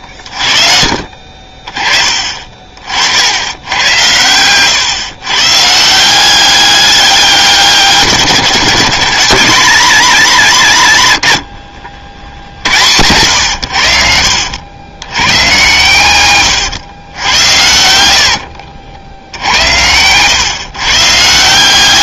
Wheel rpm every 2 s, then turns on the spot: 60, 40, 120, 200, 160, 150, 80, 80, 110, 70, 130.
18-20